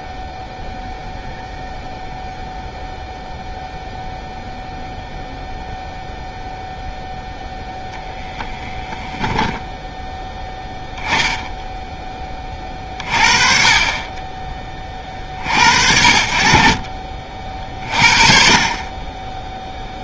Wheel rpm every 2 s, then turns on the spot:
0, 0, 0, 0, 20, 10, 40, 10, 30, 40.
8-10 12-14